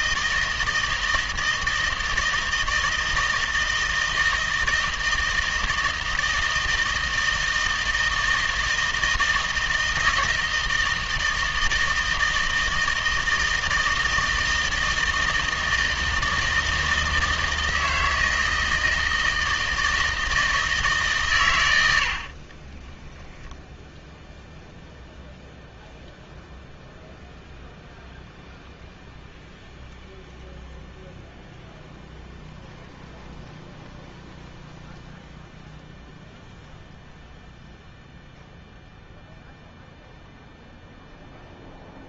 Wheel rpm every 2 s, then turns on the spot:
160, 160, 160, 160, 160, 160, 160, 160, 160, 160, 150, 10, 0, 0, 0, 0, 0, 0, 0, 0, 0.
22-24